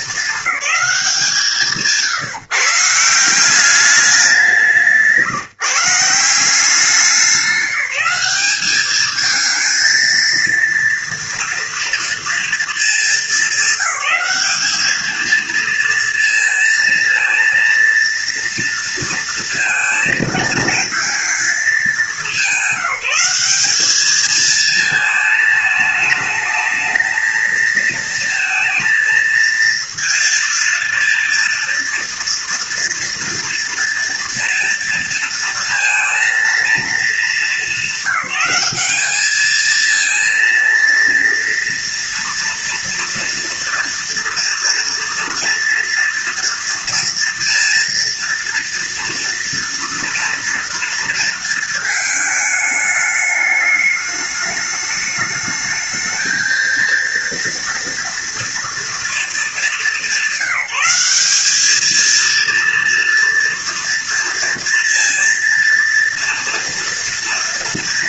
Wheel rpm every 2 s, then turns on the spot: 200, 150, 180, 180, 200, 230, 230, 210, 230, 230, 220, 190, 220, 220, 230, 230, 230, 230, 230, 210, 230, 230, 240, 230, 230, 230, 210, 210, 230, 230, 190, 230, 230, 230.
none